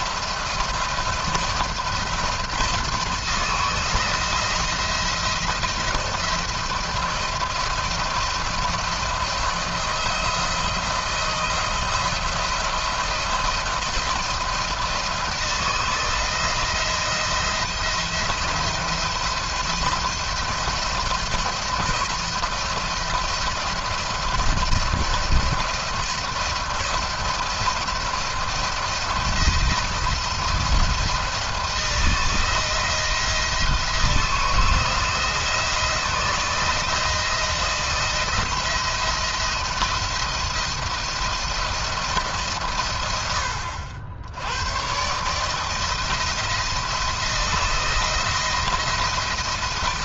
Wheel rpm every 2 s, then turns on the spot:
170, 160, 170, 170, 170, 170, 170, 170, 170, 160, 170, 170, 170, 160, 160, 170, 170, 160, 160, 170, 170, 130, 100, 170, 170.
none